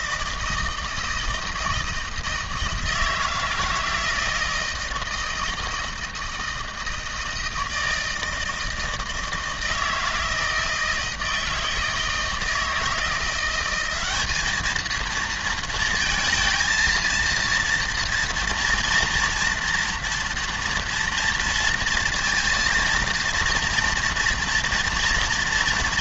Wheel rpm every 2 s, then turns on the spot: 160, 160, 160, 160, 160, 160, 160, 220, 230, 230, 230, 230, 230.
none